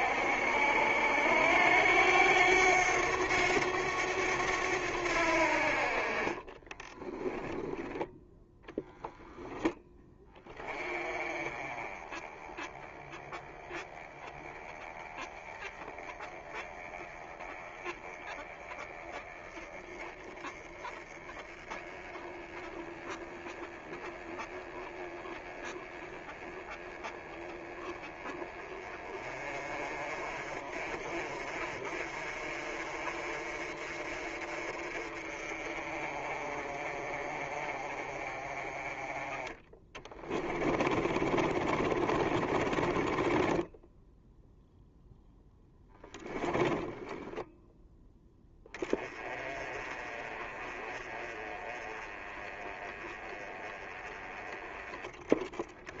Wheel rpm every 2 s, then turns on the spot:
70, 90, 90, 20, 0, 20, 20, 20, 20, 20, 20, 20, 20, 20, 20, 40, 40, 40, 30, 30, 20, 30, 0, 10, 10, 30, 20, 20.
6-8 40-44